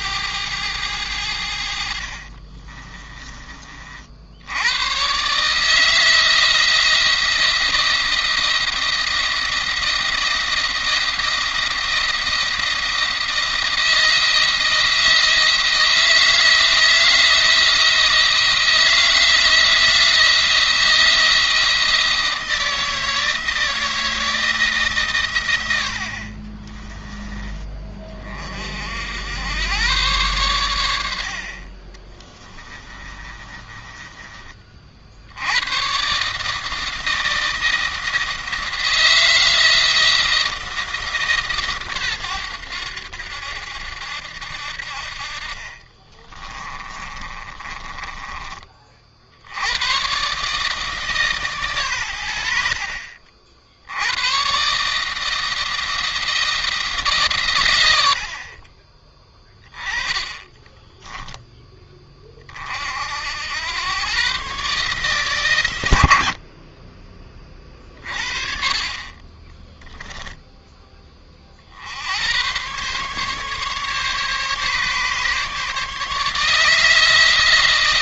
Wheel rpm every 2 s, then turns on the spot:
100, 30, 100, 170, 170, 170, 170, 160, 170, 170, 170, 160, 160, 40, 50, 100, 20, 40, 150, 160, 160, 100, 70, 30, 30, 150, 60, 150, 160, 40, 20, 40, 140, 40, 40, 10, 120, 140, 160.
2-4 26-28 32-34 46-48 60-62